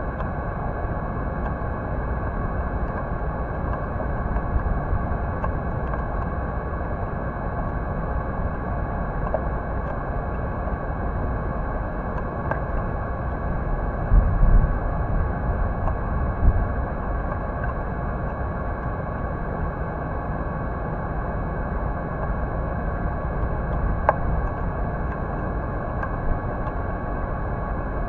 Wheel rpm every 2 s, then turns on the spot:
0, 0, 0, 0, 0, 0, 0, 0, 0, 0, 0, 0, 0, 0.
none